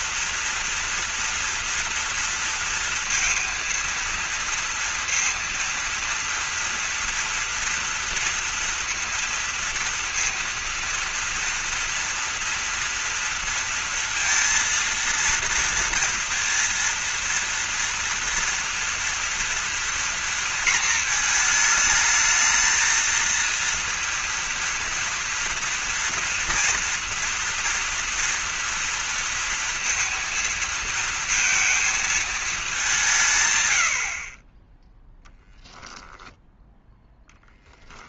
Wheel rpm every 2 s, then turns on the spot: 230, 230, 230, 230, 230, 230, 240, 230, 230, 230, 230, 220, 230, 230, 230, 230, 210, 30, 0.
none